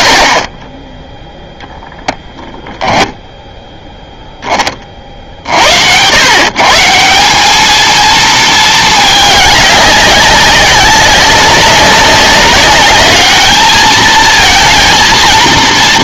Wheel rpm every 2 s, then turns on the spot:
20, 10, 30, 150, 220, 190, 200, 220.
2-4